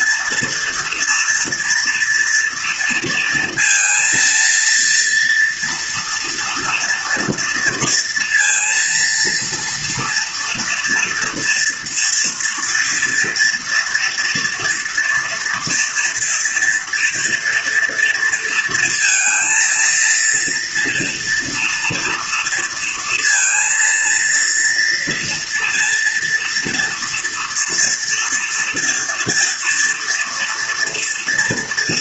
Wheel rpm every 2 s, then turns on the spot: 230, 230, 230, 230, 230, 230, 230, 230, 240, 230, 240, 230, 230, 230, 230, 230.
none